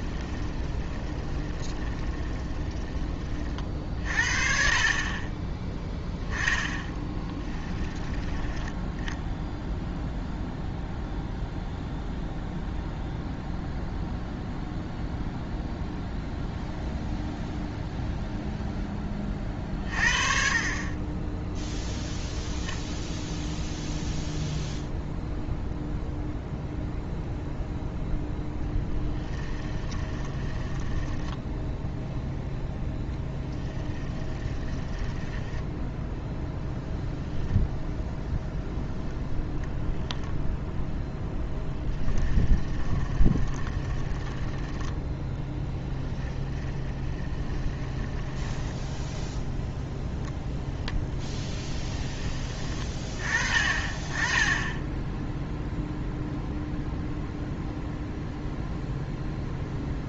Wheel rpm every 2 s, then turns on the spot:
20, 10, 40, 10, 10, 0, 0, 0, 0, 10, 30, 0, 0, 0, 10, 10, 0, 10, 0, 0, 0, 20, 10, 10, 10, 10, 30, 10, 0, 0.
0-4 6-8 30-32 34-36 42-44 46-50